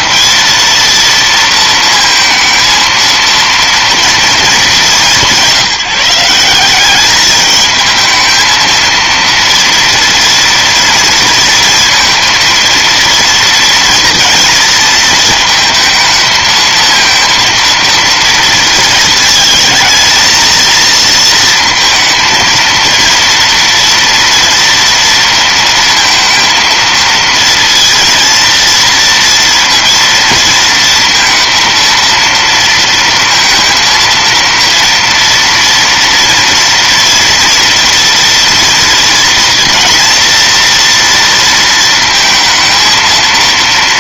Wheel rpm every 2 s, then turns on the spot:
230, 230, 180, 220, 230, 230, 230, 220, 230, 220, 230, 230, 230, 230, 230, 230, 230, 230, 230, 230, 230, 230.
none